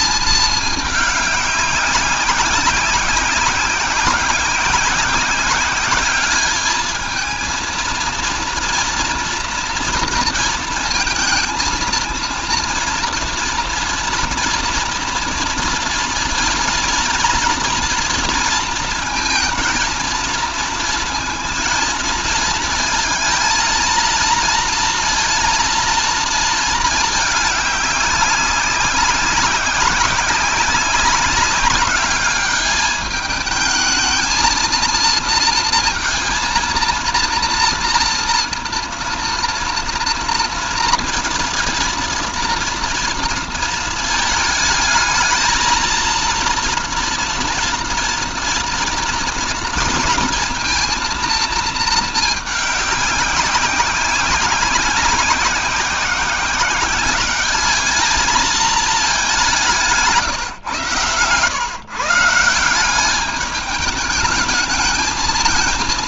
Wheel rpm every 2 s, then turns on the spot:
210, 190, 190, 210, 230, 230, 240, 230, 230, 230, 230, 230, 230, 220, 190, 190, 210, 220, 230, 230, 230, 230, 220, 230, 230, 230, 210, 190, 190, 220, 130, 170, 210.
none